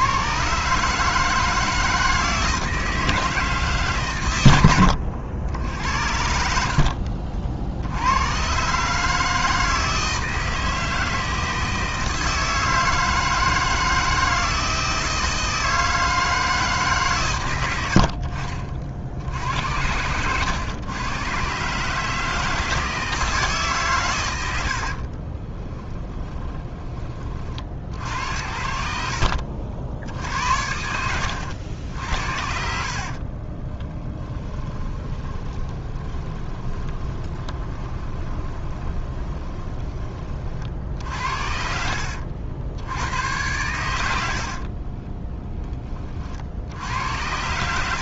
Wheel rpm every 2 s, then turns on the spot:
140, 160, 90, 60, 140, 160, 160, 160, 140, 60, 110, 160, 80, 20, 60, 80, 60, 20, 20, 20, 50, 90, 30, 80.
24-26 28-42 44-46